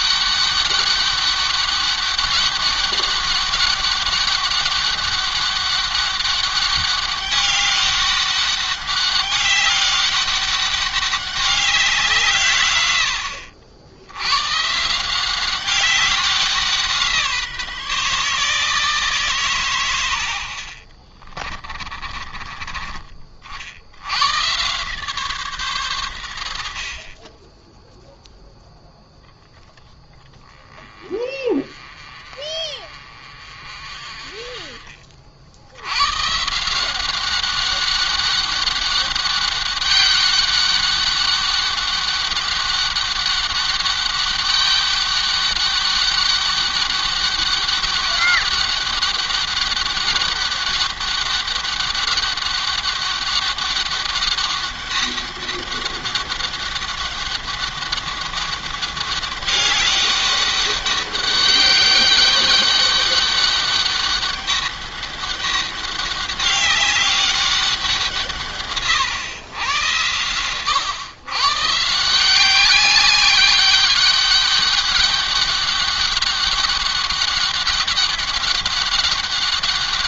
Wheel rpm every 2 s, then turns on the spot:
200, 200, 200, 200, 200, 200, 110, 140, 180, 150, 70, 30, 130, 60, 0, 20, 40, 40, 160, 200, 200, 200, 200, 200, 200, 200, 200, 200, 200, 200, 190, 200, 200, 200, 140, 120, 200, 200, 200, 200.
20-22